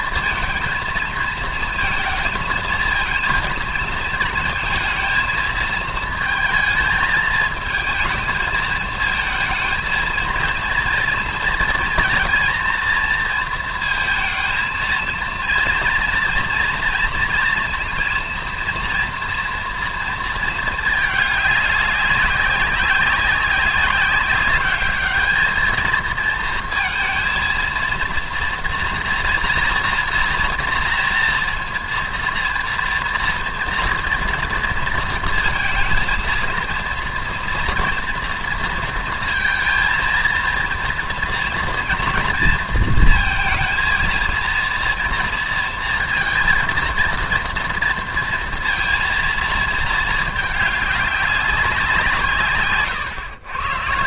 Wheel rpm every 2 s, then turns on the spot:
230, 230, 220, 220, 220, 230, 230, 230, 230, 230, 220, 190, 200, 230, 230, 240, 230, 230, 230, 230, 230, 230, 230, 230, 230, 210, 130.
52-54